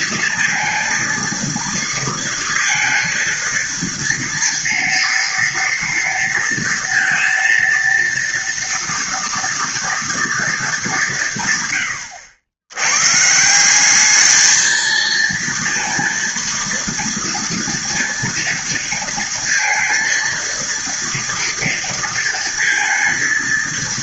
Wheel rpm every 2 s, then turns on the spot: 230, 230, 230, 230, 230, 180, 130, 220, 230, 230, 230, 230.
none